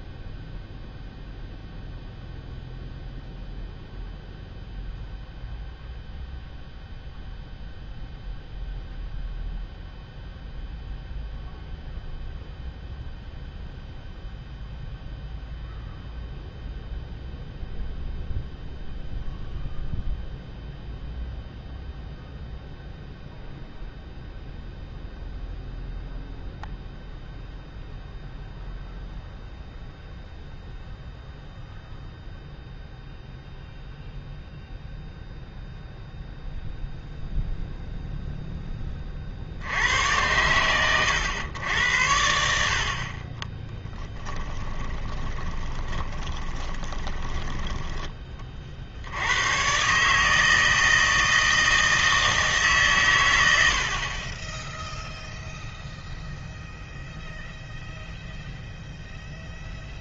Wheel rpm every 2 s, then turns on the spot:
0, 0, 0, 0, 0, 0, 0, 0, 0, 0, 0, 0, 0, 0, 0, 0, 0, 0, 0, 10, 100, 60, 20, 20, 50, 160, 140, 0, 0, 0.
44-48